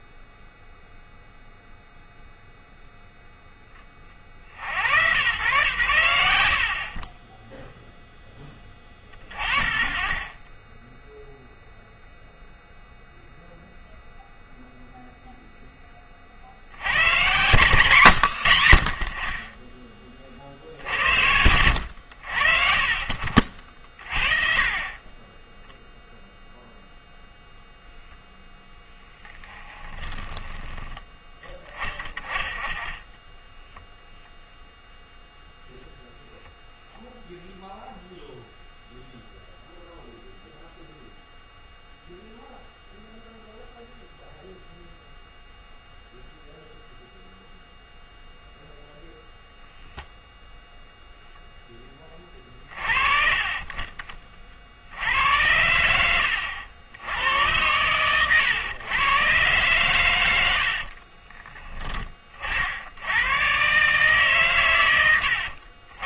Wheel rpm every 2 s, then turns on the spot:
0, 0, 70, 80, 10, 10, 0, 0, 70, 80, 50, 50, 40, 0, 10, 10, 10, 0, 0, 0, 0, 0, 0, 0, 0, 0, 40, 50, 80, 110, 80, 60, 120.
60-62